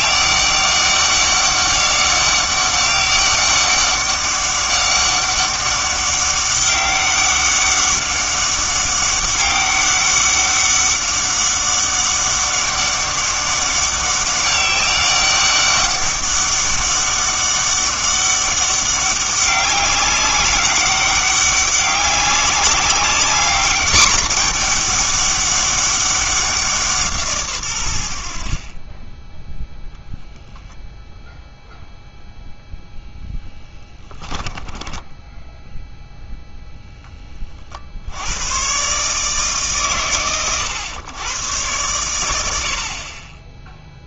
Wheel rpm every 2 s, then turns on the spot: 200, 200, 200, 200, 200, 200, 200, 200, 200, 200, 190, 200, 210, 170, 40, 0, 0, 10, 0, 120, 110, 60.
28-30 34-36